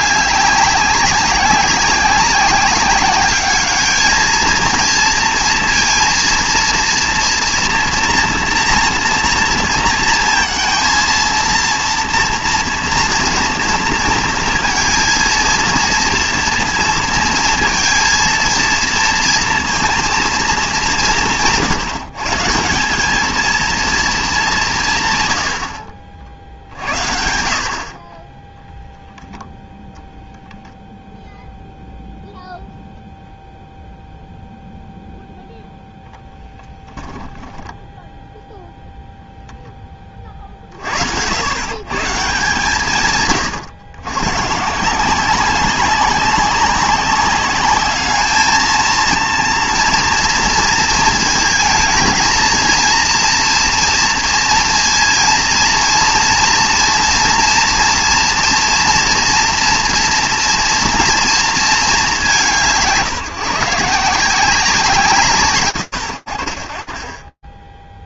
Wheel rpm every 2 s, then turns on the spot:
200, 190, 230, 230, 240, 230, 230, 230, 230, 230, 220, 170, 180, 60, 0, 0, 0, 0, 10, 0, 50, 160, 140, 190, 220, 230, 230, 230, 230, 230, 230, 170, 180, 30.
36-38